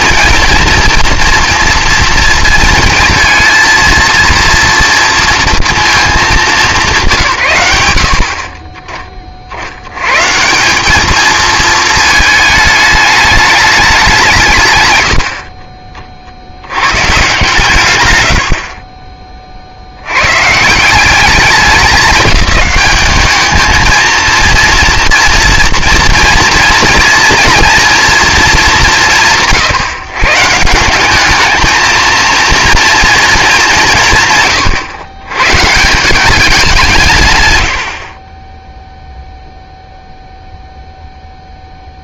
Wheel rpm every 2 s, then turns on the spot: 230, 230, 230, 210, 40, 180, 210, 130, 100, 60, 160, 200, 230, 230, 220, 170, 230, 120, 180, 10, 0.
18-20